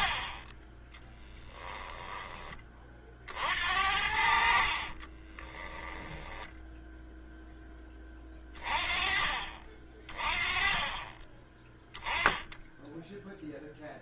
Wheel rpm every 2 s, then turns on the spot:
10, 40, 40, 0, 30, 30, 10.
0-2 4-6